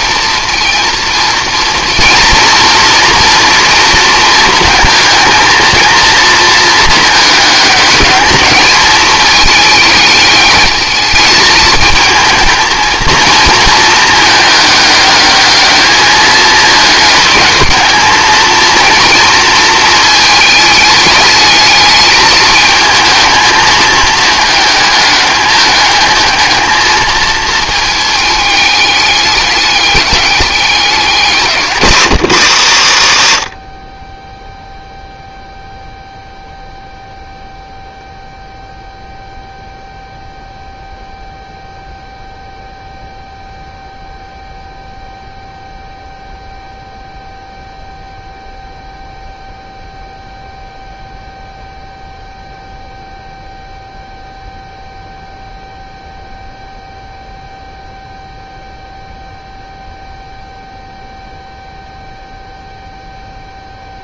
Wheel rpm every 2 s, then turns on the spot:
230, 230, 220, 220, 210, 210, 230, 210, 210, 230, 210, 220, 210, 220, 210, 200, 110, 0, 0, 0, 0, 0, 0, 0, 0, 0, 0, 0, 0, 0, 0, 0.
none